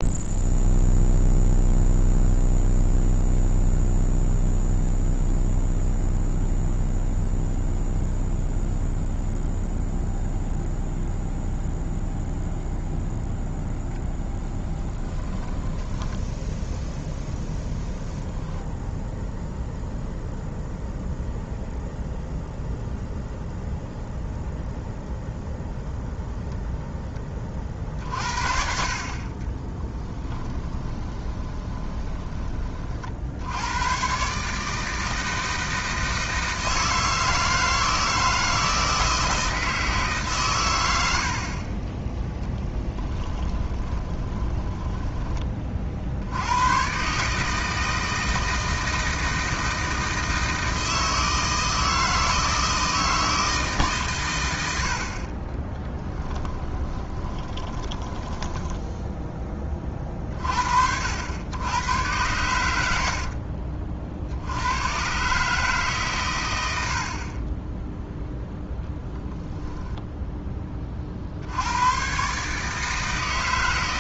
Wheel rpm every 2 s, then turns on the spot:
0, 0, 0, 0, 0, 0, 0, 20, 0, 0, 0, 0, 0, 0, 60, 20, 40, 160, 160, 160, 100, 10, 20, 110, 160, 160, 160, 80, 20, 10, 60, 80, 100, 80, 0, 20, 150.
14-16 30-32 42-46 56-60